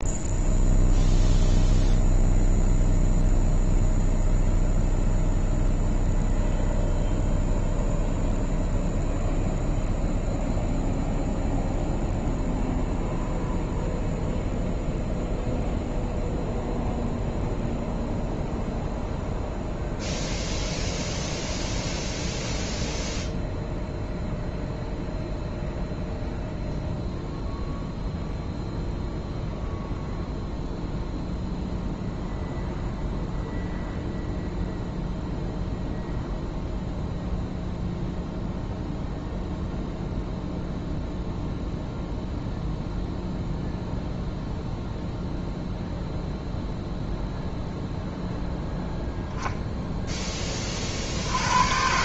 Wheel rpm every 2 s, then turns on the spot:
0, 0, 0, 0, 0, 0, 0, 0, 0, 0, 0, 0, 0, 0, 0, 0, 0, 0, 0, 0, 0, 0, 0, 0, 0, 70.
none